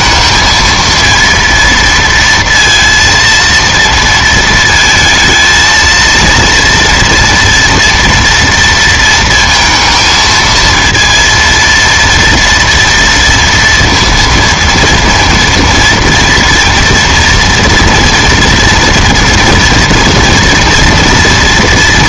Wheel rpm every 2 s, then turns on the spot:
230, 230, 230, 230, 230, 230, 230, 230, 230, 240, 230.
none